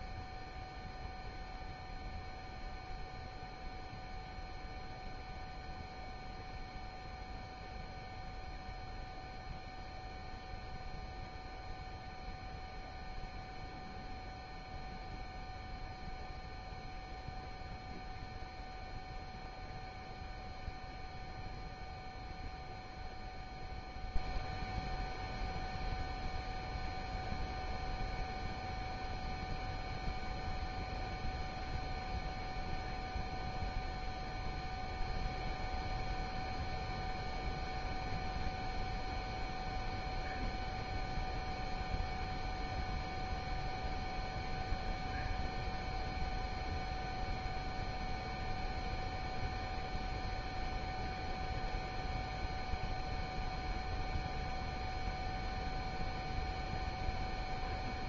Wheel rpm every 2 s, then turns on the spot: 0, 0, 0, 0, 0, 0, 0, 0, 0, 0, 0, 0, 0, 0, 0, 0, 0, 0, 0, 0, 0, 0, 0, 0, 0, 0, 0, 0, 0.
none